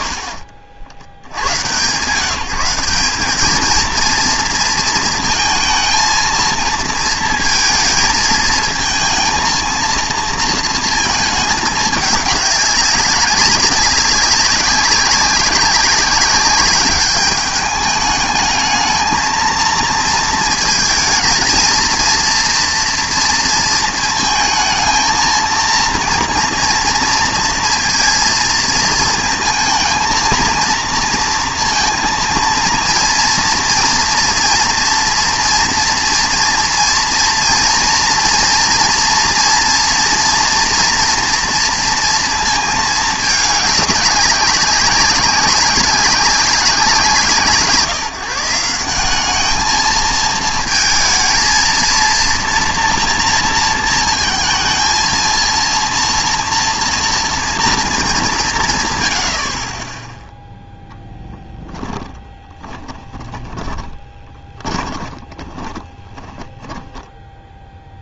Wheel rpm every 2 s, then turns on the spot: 70, 170, 230, 220, 220, 230, 200, 190, 200, 220, 230, 230, 220, 230, 230, 230, 230, 240, 230, 240, 230, 230, 200, 180, 170, 220, 230, 230, 230, 170, 0, 10, 20, 10.
62-68